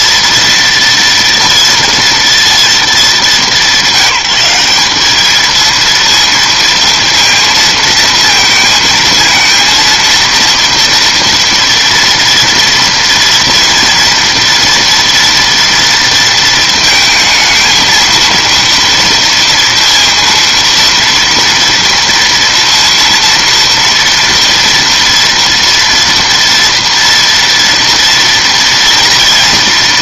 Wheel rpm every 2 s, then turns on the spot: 230, 210, 200, 230, 220, 230, 230, 240, 220, 230, 230, 230, 230, 230, 230.
none